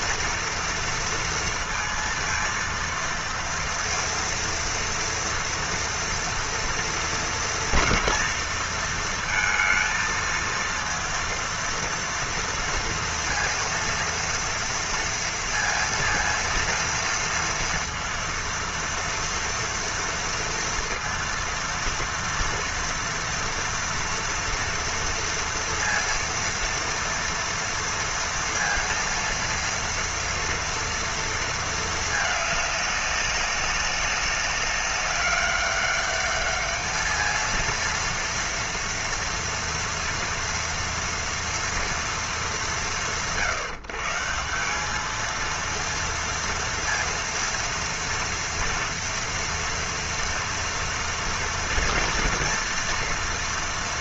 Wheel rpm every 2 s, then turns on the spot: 230, 230, 230, 230, 230, 230, 230, 230, 230, 230, 230, 230, 230, 230, 230, 230, 210, 200, 210, 230, 230, 210, 170, 230, 240, 230, 230.
none